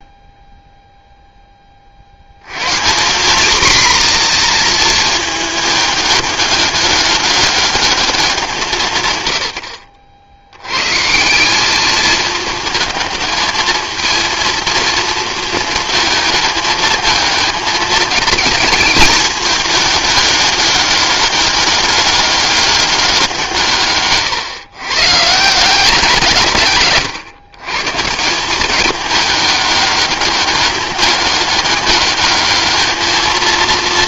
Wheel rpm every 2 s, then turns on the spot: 0, 130, 240, 210, 170, 110, 220, 230, 220, 220, 200, 200, 120, 140, 190, 200, 210.
none